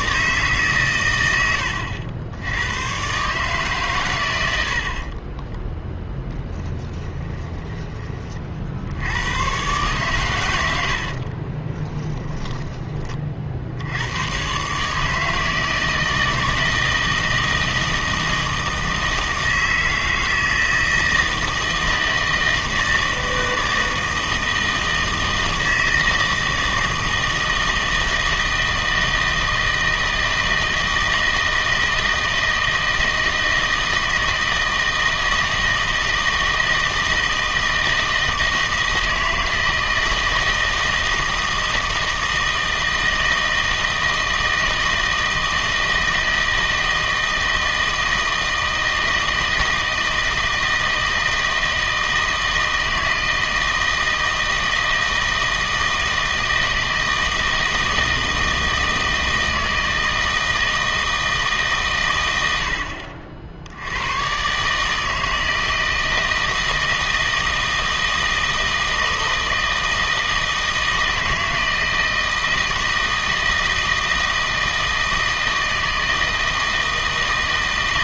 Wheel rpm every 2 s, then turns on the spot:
130, 90, 70, 10, 50, 100, 20, 140, 160, 160, 160, 160, 160, 160, 160, 160, 160, 160, 160, 160, 160, 160, 160, 160, 160, 160, 160, 160, 160, 160, 160, 80, 140, 160, 160, 160, 160, 160, 160.
6-8 10-12